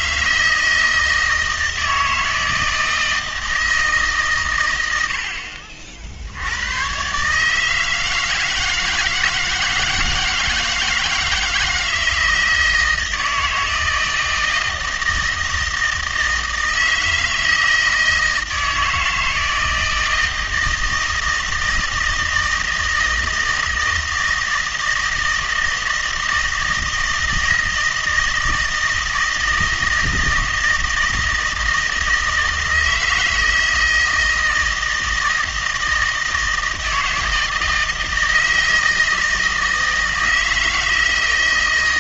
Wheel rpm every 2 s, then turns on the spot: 160, 160, 110, 110, 160, 160, 160, 160, 160, 160, 160, 160, 160, 160, 160, 160, 160, 160, 160, 160, 160.
none